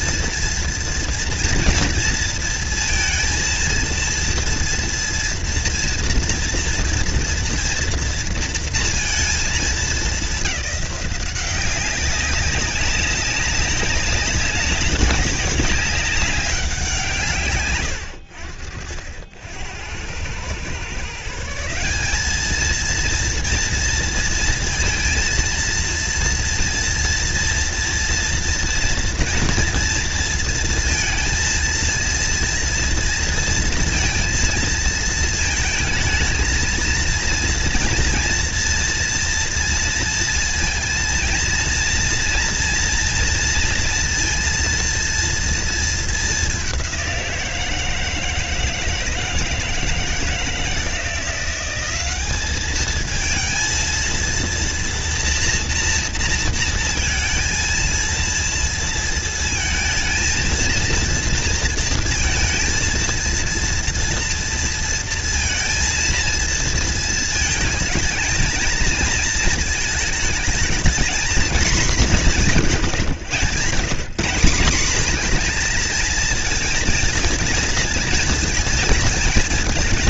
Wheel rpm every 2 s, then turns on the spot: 230, 230, 230, 230, 230, 200, 190, 190, 190, 70, 110, 210, 230, 230, 230, 230, 230, 230, 220, 240, 230, 230, 230, 200, 160, 170, 200, 230, 230, 230, 230, 230, 230, 230, 230, 220, 180, 190, 230, 230.
none